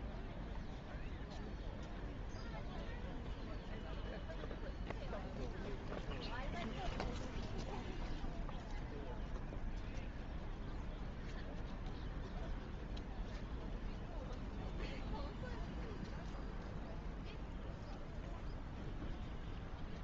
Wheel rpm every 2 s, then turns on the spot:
0, 0, 0, 0, 0, 0, 0, 0, 0, 0.
none